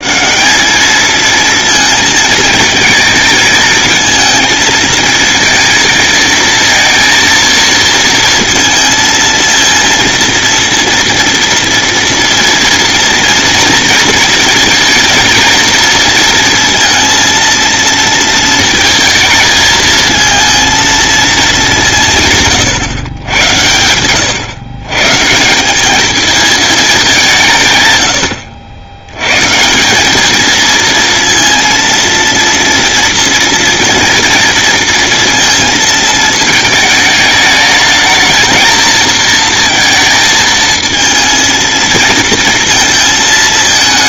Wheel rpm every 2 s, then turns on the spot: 220, 220, 220, 230, 230, 230, 230, 230, 230, 230, 230, 130, 140, 200, 100, 230, 230, 230, 220, 220, 220, 230.
none